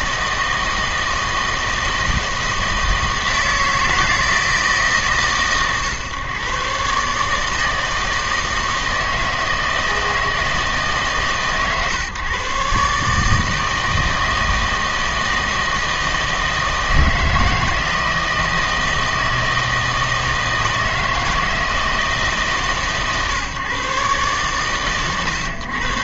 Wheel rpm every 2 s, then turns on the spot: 160, 160, 160, 130, 160, 160, 140, 160, 160, 160, 160, 150, 130.
none